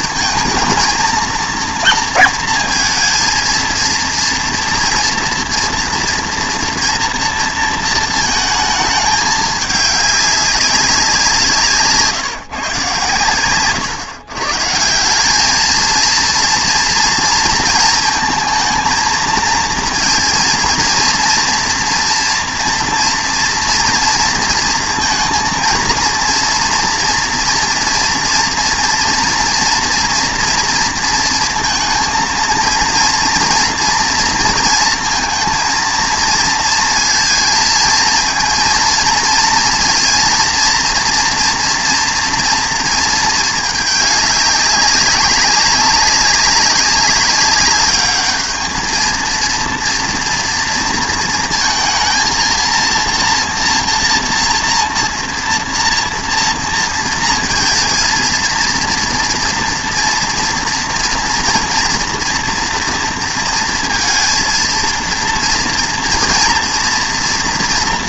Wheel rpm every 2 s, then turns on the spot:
220, 230, 230, 230, 220, 200, 140, 140, 230, 230, 230, 230, 230, 230, 230, 230, 230, 230, 230, 230, 230, 230, 200, 190, 220, 230, 230, 230, 230, 230, 230, 230, 230, 230.
none